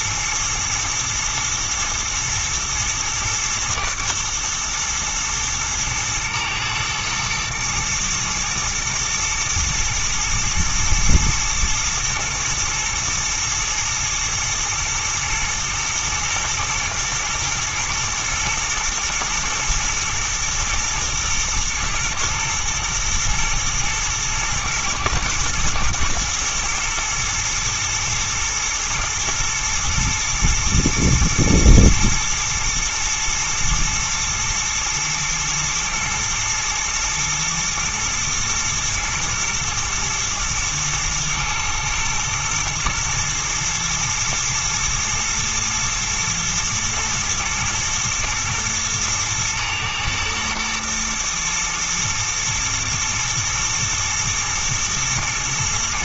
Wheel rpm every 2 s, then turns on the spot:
110, 110, 110, 110, 110, 110, 120, 110, 110, 120, 120, 120, 110, 110, 120, 110, 110, 120, 110, 120, 110, 110, 120, 120, 120, 120, 110, 110.
none